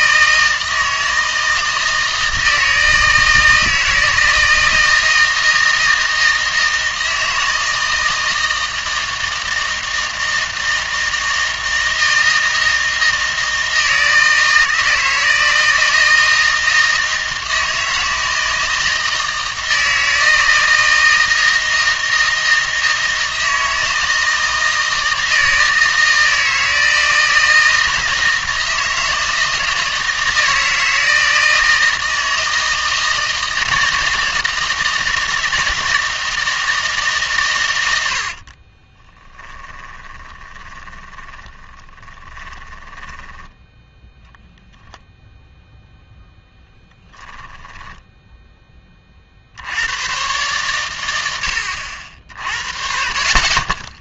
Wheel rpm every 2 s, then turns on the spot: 160, 160, 160, 160, 160, 160, 160, 160, 160, 160, 160, 160, 160, 160, 160, 160, 160, 160, 160, 30, 20, 10, 0, 10, 10, 110, 50.
38-44 46-48